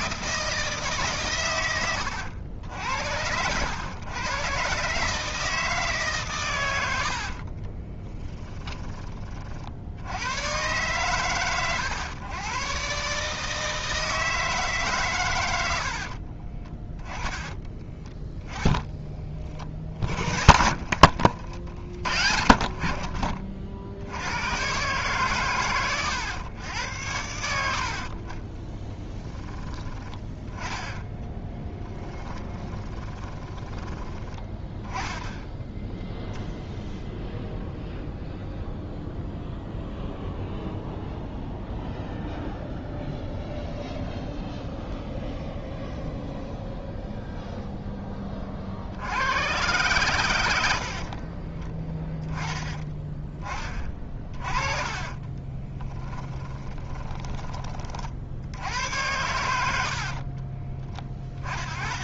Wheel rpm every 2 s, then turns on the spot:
150, 80, 140, 80, 30, 120, 130, 140, 20, 10, 60, 60, 130, 90, 10, 10, 20, 20, 0, 0, 0, 0, 0, 0, 70, 60, 20, 30, 20, 90, 20.
6-8 18-22 28-34 50-52 54-58